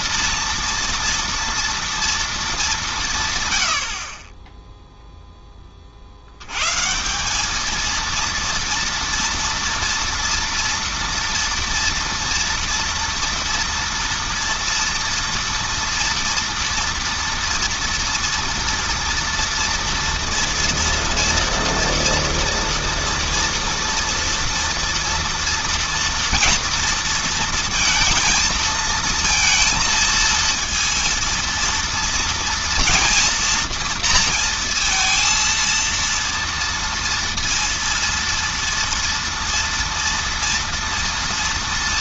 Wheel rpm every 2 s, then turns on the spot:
230, 170, 0, 180, 230, 240, 230, 230, 230, 230, 240, 230, 230, 230, 230, 230, 230, 230, 230, 230, 230.
none